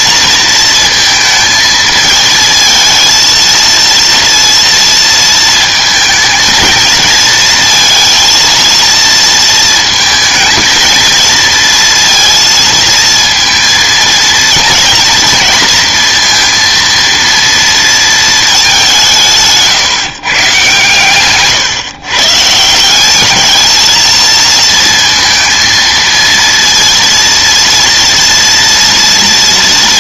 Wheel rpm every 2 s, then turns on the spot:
230, 220, 230, 220, 230, 220, 230, 230, 230, 200, 140, 160, 230, 230, 230.
none